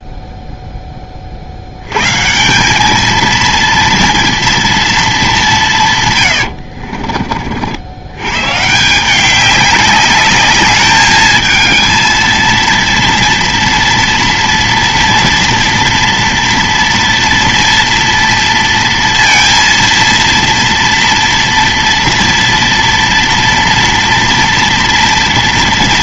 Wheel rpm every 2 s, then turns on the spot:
0, 180, 230, 90, 130, 210, 230, 230, 230, 230, 230, 230, 230.
6-8